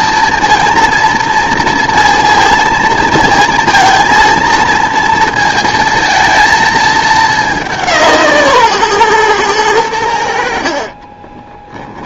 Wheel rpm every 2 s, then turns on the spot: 230, 230, 230, 220, 140, 60.
none